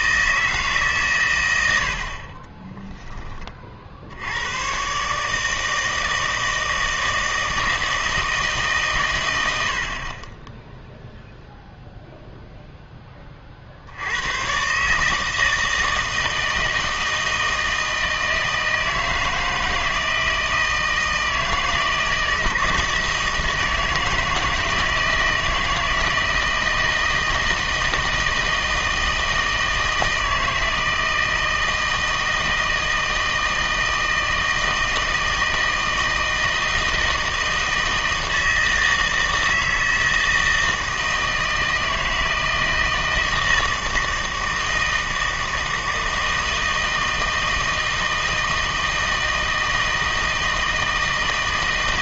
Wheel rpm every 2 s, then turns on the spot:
160, 20, 110, 160, 150, 10, 0, 120, 160, 160, 160, 160, 160, 160, 160, 160, 160, 160, 160, 160, 160, 160, 160, 160, 160, 160.
2-4